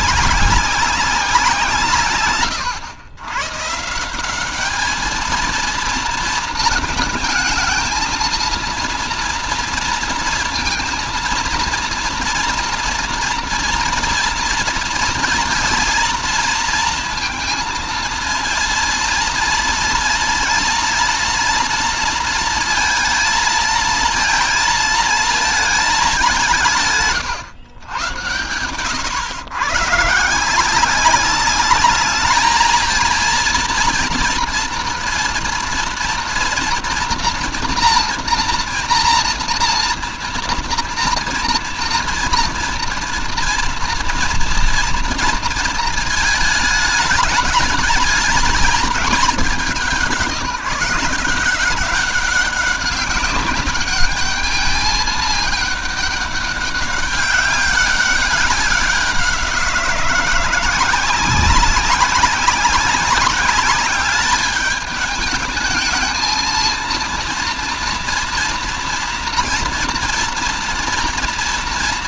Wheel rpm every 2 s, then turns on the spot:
190, 100, 200, 220, 230, 230, 240, 230, 230, 230, 240, 230, 220, 170, 100, 170, 220, 230, 240, 230, 230, 230, 230, 220, 220, 180, 190, 210, 200, 190, 180, 190, 210, 230, 230, 230.
none